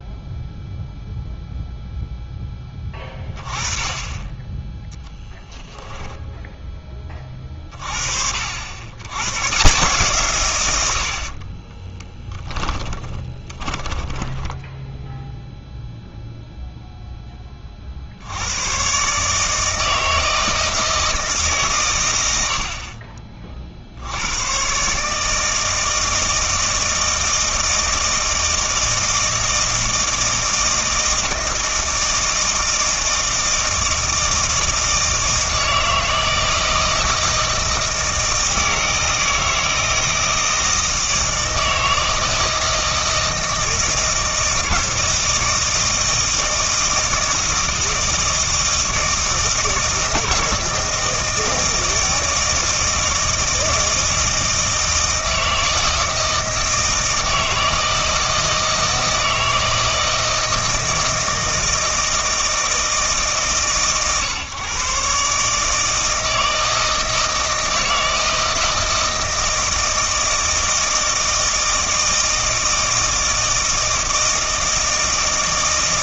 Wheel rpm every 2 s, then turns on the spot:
0, 10, 10, 20, 80, 100, 20, 10, 0, 120, 160, 50, 130, 160, 160, 160, 160, 160, 160, 160, 160, 160, 160, 160, 160, 160, 160, 160, 160, 160, 160, 160, 130, 160, 160, 160, 160, 160.
12-16